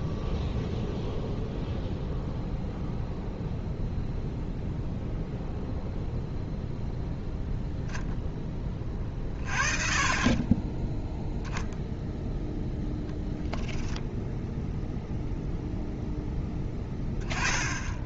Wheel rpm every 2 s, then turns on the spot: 0, 0, 0, 0, 20, 10, 0, 0, 10.
none